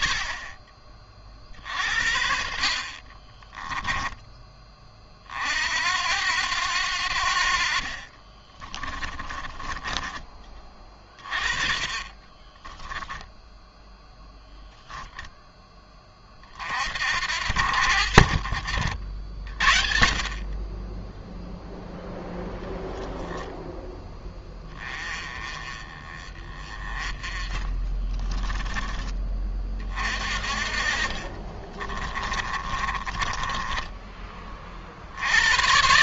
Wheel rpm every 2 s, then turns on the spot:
30, 50, 30, 80, 30, 30, 20, 0, 50, 70, 30, 10, 20, 20, 20, 40, 30, 50.
2-4 8-10 12-14 30-34